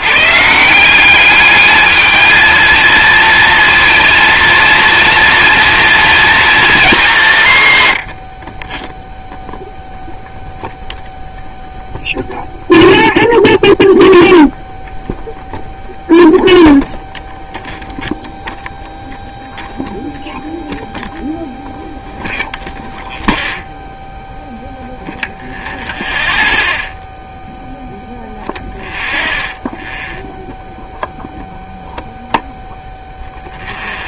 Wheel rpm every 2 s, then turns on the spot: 170, 230, 230, 220, 20, 0, 0, 0, 0, 0, 0, 0, 0, 0, 0, 0, 0.
none